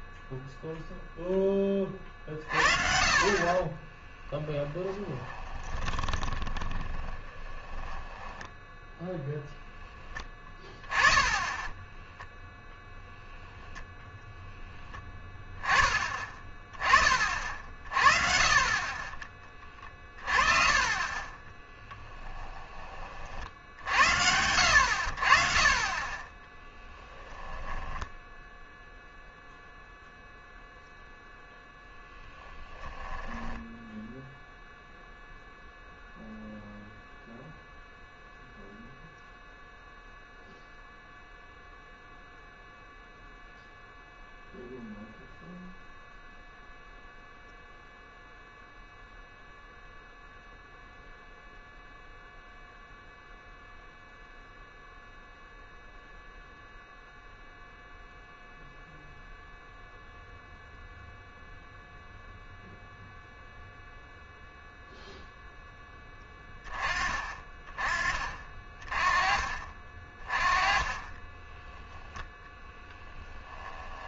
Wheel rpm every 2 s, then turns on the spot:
0, 50, 20, 30, 10, 10, 0, 10, 20, 40, 30, 20, 70, 10, 0, 0, 10, 0, 0, 0, 0, 0, 0, 0, 0, 0, 0, 0, 0, 0, 0, 0, 0, 20, 30, 20, 10.
4-10 26-28 32-34 70-74